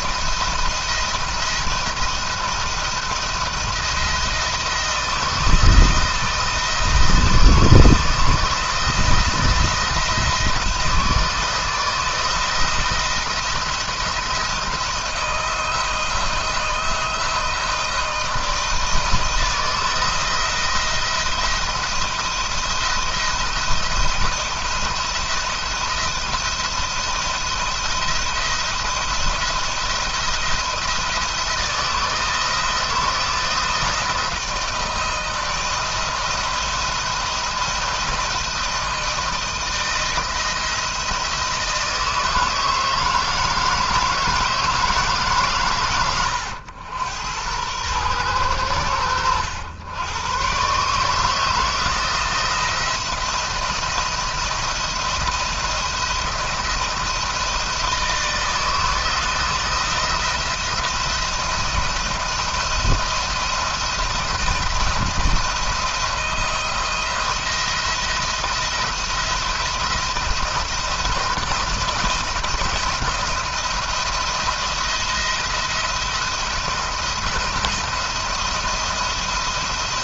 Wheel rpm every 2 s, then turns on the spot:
170, 170, 170, 160, 160, 170, 160, 170, 160, 160, 170, 170, 170, 170, 170, 170, 160, 160, 170, 170, 160, 160, 160, 110, 110, 120, 170, 170, 170, 160, 170, 170, 170, 170, 170, 160, 170, 170, 170, 170.
none